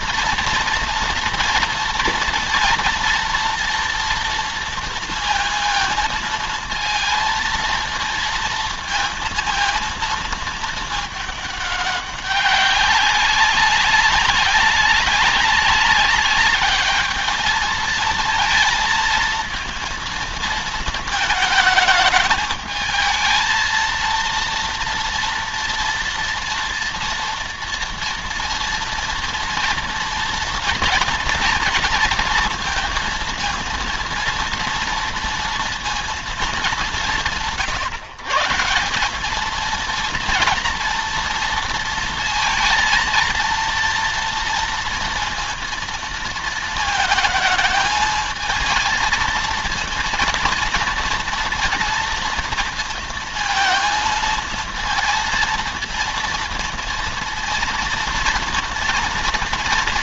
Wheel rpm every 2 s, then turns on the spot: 230, 230, 230, 230, 230, 220, 200, 200, 210, 230, 220, 220, 230, 230, 230, 230, 220, 230, 200, 180, 230, 230, 230, 220, 220, 230, 230, 230, 230, 230.
none